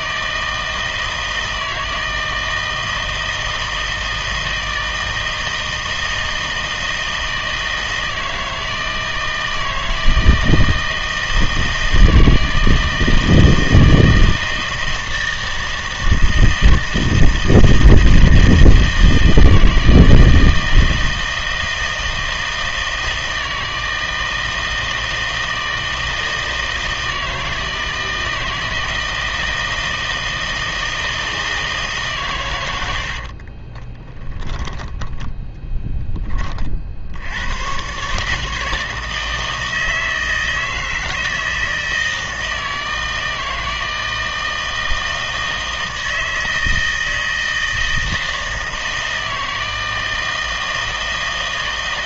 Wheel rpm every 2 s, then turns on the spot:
160, 160, 160, 160, 160, 160, 160, 160, 160, 160, 160, 160, 160, 160, 160, 160, 110, 10, 30, 150, 160, 160, 160, 160, 160, 160.
34-36